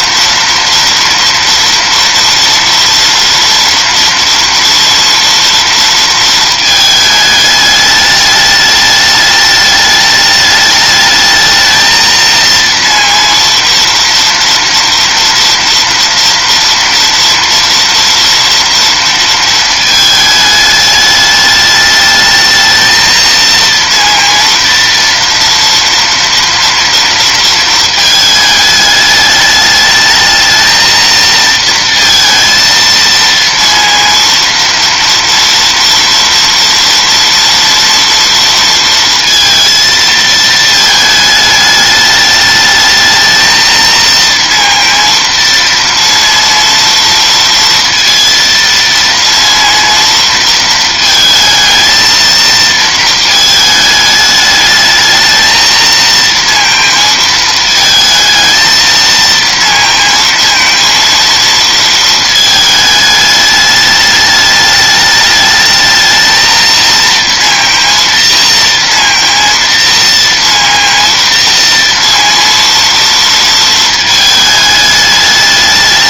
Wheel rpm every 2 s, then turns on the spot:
230, 230, 230, 220, 210, 210, 230, 230, 230, 230, 210, 220, 230, 230, 210, 220, 230, 230, 230, 230, 220, 210, 230, 230, 230, 230, 230, 210, 230, 220, 230, 220, 210, 230, 230, 230, 230, 210.
none